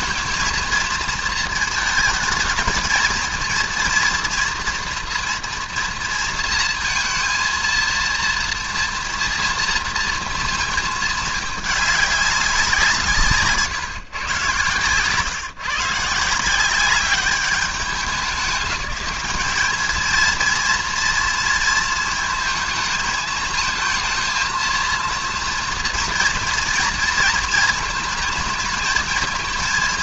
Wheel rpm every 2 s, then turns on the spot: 230, 230, 230, 230, 230, 220, 180, 120, 190, 200, 230, 220, 230, 230, 220.
none